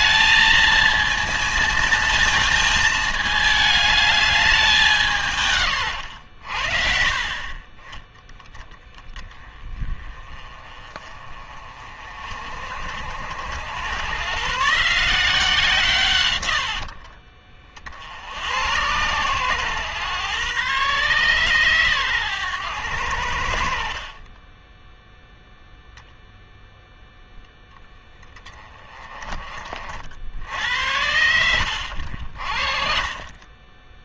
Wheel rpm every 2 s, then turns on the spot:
230, 220, 200, 60, 10, 30, 60, 150, 70, 90, 130, 100, 10, 0, 20, 80, 40.
30-32